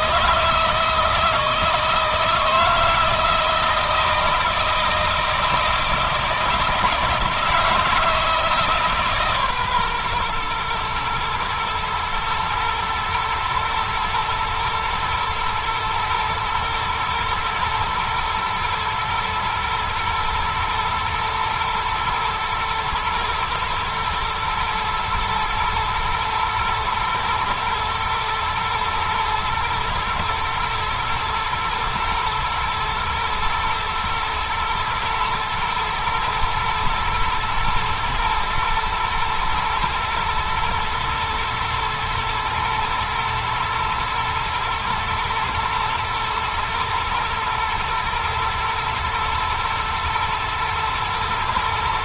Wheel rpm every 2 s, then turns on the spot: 160, 160, 160, 160, 150, 120, 110, 110, 110, 110, 120, 110, 110, 110, 110, 120, 120, 110, 110, 110, 120, 110, 110, 110, 110, 110.
none